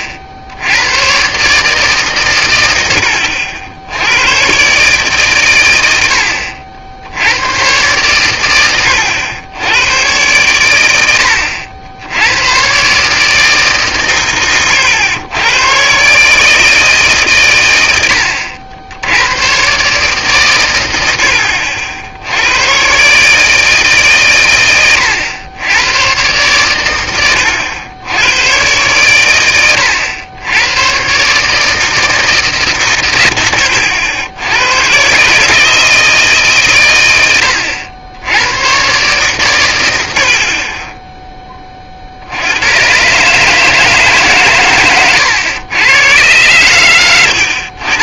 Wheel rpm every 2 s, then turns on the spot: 110, 90, 140, 70, 100, 100, 150, 110, 140, 90, 80, 140, 100, 100, 110, 130, 120, 130, 100, 130, 10, 120, 110, 110.
none